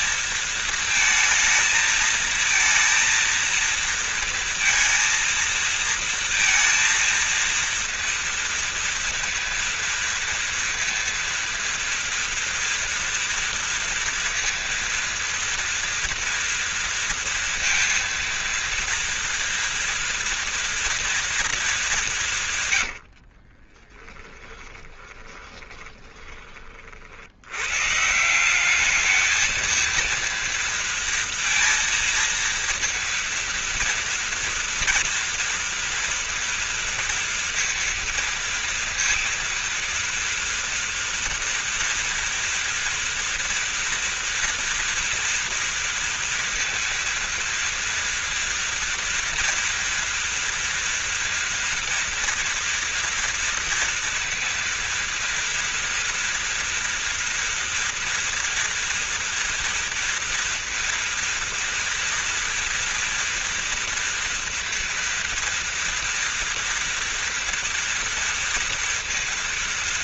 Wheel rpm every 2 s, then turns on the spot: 230, 220, 230, 230, 230, 230, 230, 230, 230, 230, 230, 180, 20, 20, 170, 230, 230, 230, 230, 230, 230, 230, 230, 230, 230, 230, 230, 230, 230, 230, 230, 230, 230, 240, 230.
24-26